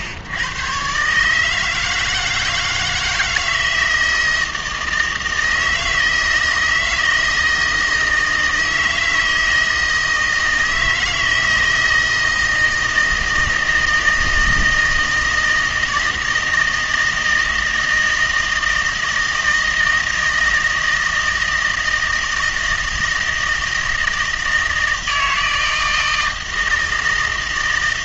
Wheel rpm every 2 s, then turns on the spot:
120, 160, 160, 160, 160, 160, 160, 160, 160, 160, 160, 160, 160, 160.
none